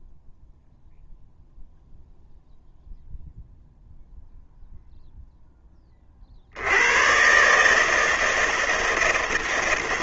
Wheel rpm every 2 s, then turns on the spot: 0, 0, 0, 100, 160.
none